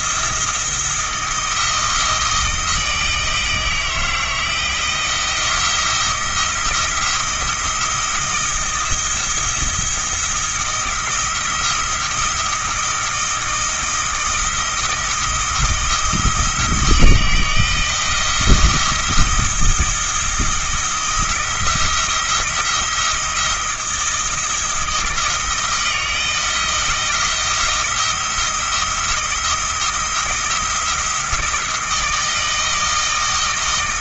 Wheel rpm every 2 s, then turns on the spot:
170, 160, 170, 170, 170, 170, 170, 170, 160, 170, 170, 170, 160, 160, 170, 170, 160.
none